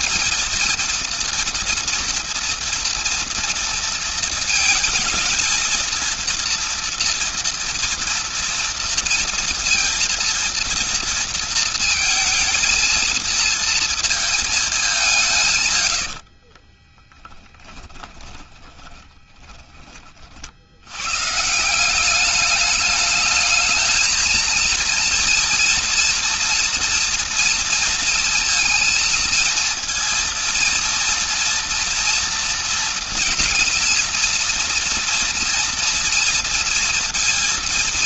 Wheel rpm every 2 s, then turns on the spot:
230, 230, 220, 230, 230, 230, 230, 200, 20, 10, 80, 210, 230, 240, 230, 230, 230, 240, 230.
16-20